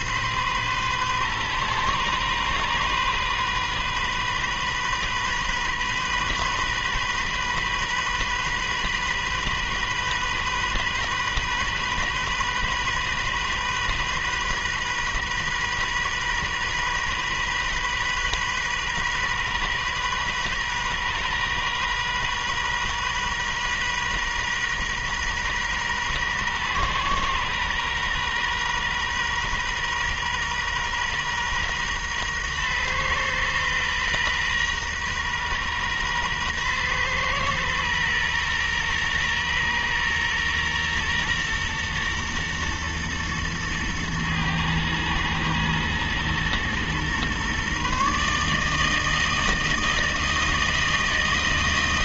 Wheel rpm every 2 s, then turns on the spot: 130, 130, 130, 130, 130, 130, 130, 130, 130, 130, 130, 130, 130, 130, 120, 120, 120, 130, 120, 120, 120, 120, 110, 120, 150, 160.
none